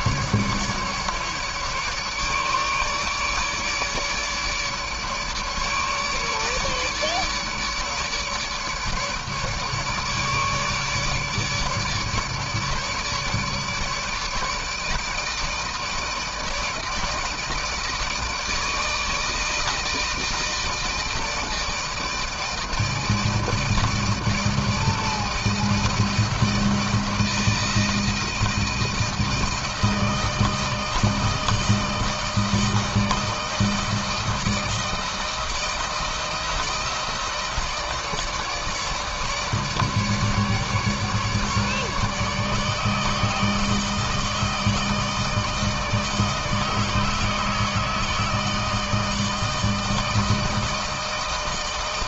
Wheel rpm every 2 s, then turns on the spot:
150, 150, 150, 150, 150, 150, 150, 150, 160, 160, 160, 160, 160, 160, 160, 160, 160, 160, 160, 160, 150, 150, 160, 160, 160, 160.
none